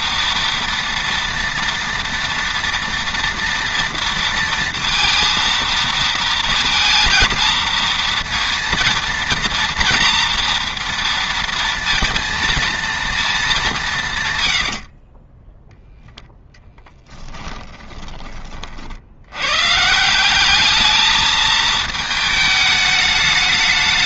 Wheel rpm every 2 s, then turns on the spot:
230, 230, 230, 230, 230, 230, 230, 90, 10, 50, 210, 210.
14-16